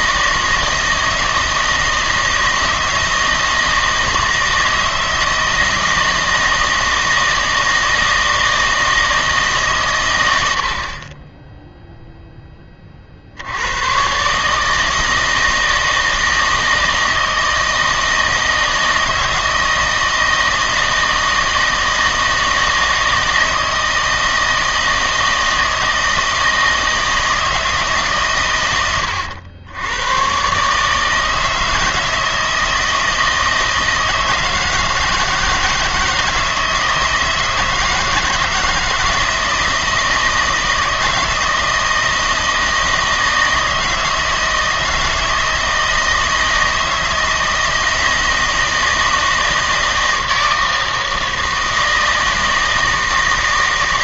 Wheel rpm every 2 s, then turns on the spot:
160, 160, 160, 160, 160, 60, 20, 150, 160, 160, 160, 160, 160, 160, 110, 140, 160, 160, 160, 160, 160, 160, 160, 160, 160, 160, 160.
none